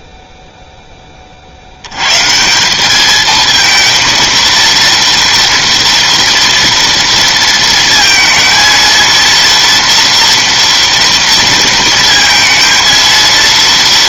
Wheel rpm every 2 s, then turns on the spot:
0, 150, 230, 230, 230, 230, 230.
none